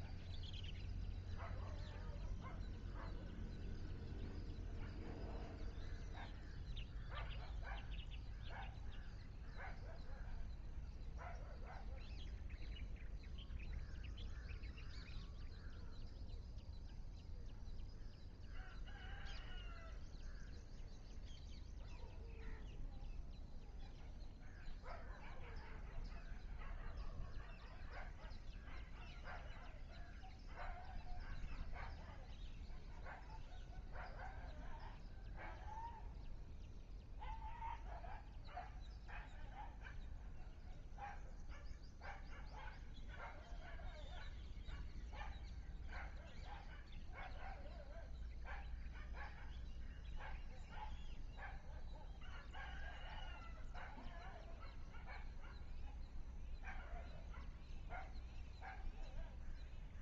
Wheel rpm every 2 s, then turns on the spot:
0, 0, 0, 0, 0, 0, 0, 0, 0, 0, 0, 0, 0, 0, 0, 0, 0, 0, 0, 0, 0, 0, 0, 0, 0, 0, 0, 0, 0, 0.
none